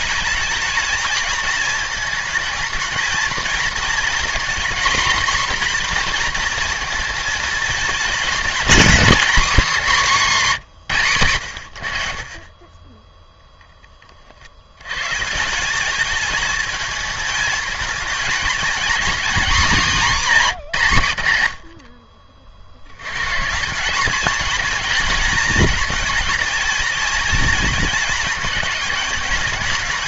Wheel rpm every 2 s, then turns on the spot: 210, 220, 240, 230, 230, 190, 20, 90, 220, 230, 190, 70, 220, 220, 210.
none